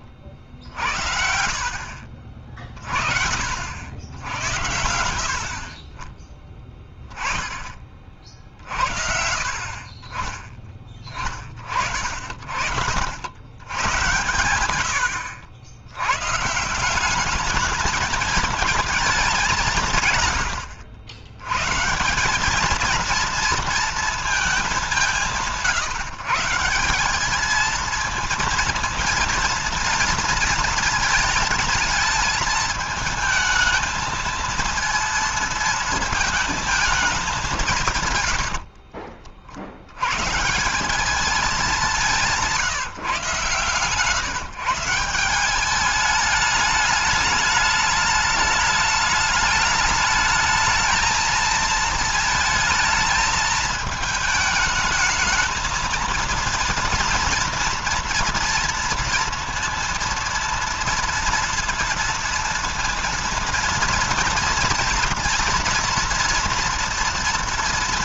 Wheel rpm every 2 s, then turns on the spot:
60, 30, 80, 10, 50, 20, 60, 110, 150, 220, 80, 210, 210, 170, 230, 230, 220, 230, 220, 80, 150, 170, 160, 210, 210, 220, 220, 220, 230, 230, 230, 230, 230, 230.
4-6 38-40